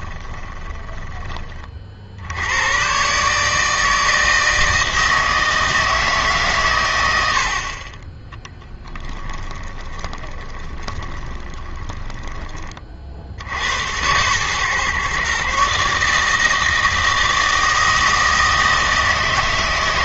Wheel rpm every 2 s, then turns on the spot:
10, 110, 160, 130, 10, 20, 30, 130, 160, 160.
0-2 8-12